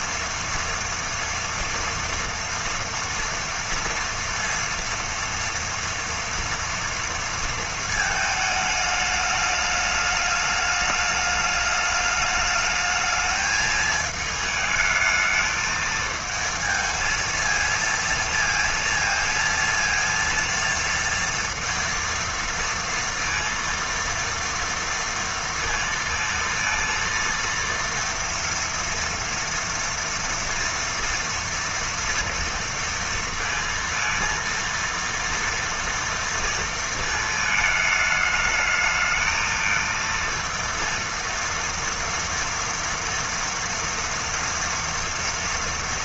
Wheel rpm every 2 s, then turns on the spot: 230, 230, 230, 230, 220, 210, 210, 220, 230, 230, 230, 230, 230, 230, 230, 230, 230, 230, 230, 210, 230, 230, 230.
none